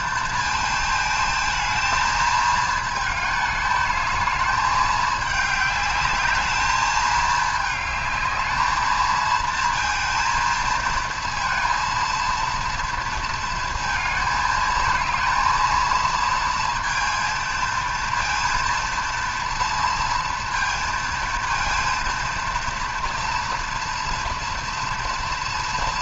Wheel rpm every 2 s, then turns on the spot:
220, 220, 210, 210, 220, 220, 230, 220, 230, 230, 230, 230, 240.
none